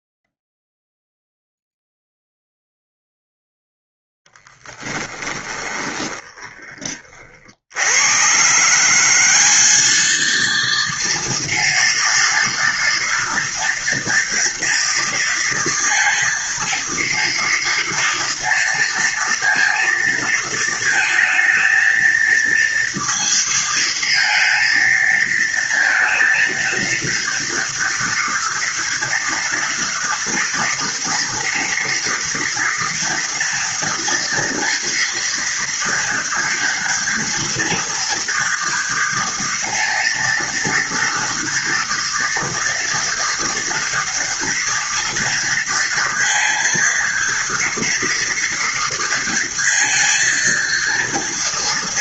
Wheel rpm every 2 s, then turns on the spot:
0, 0, 20, 40, 190, 230, 230, 230, 230, 230, 220, 230, 230, 230, 230, 230, 230, 230, 230, 230, 230, 230, 230, 230, 230, 230.
4-6